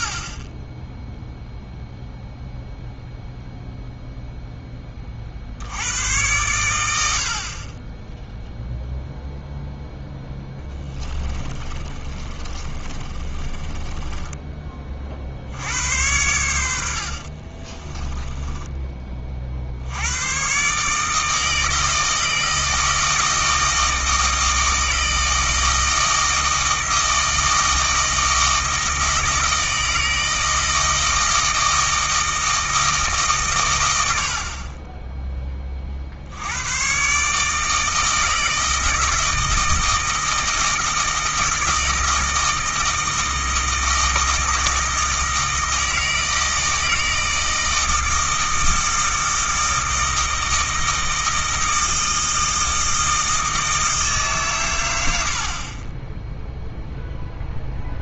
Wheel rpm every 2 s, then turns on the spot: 0, 0, 20, 80, 0, 20, 30, 30, 70, 10, 140, 160, 160, 160, 160, 160, 160, 30, 90, 160, 160, 160, 160, 160, 160, 160, 160, 130, 0.
10-14 16-18